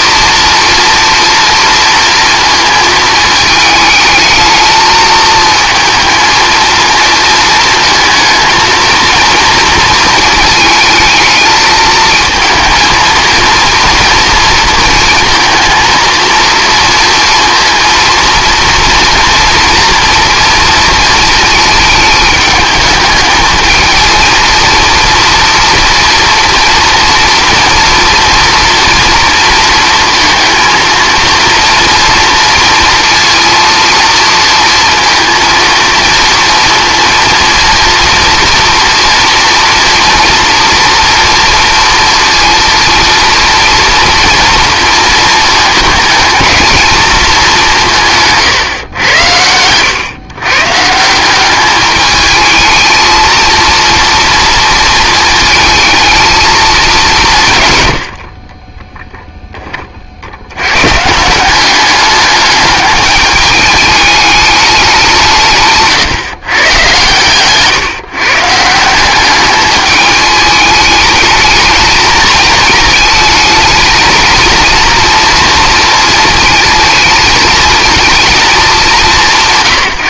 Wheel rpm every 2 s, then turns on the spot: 240, 230, 220, 220, 230, 220, 230, 230, 230, 230, 230, 220, 230, 230, 230, 230, 230, 230, 230, 230, 230, 230, 230, 230, 130, 140, 220, 230, 220, 30, 110, 210, 200, 120, 160, 210, 220, 230, 220, 210.
58-60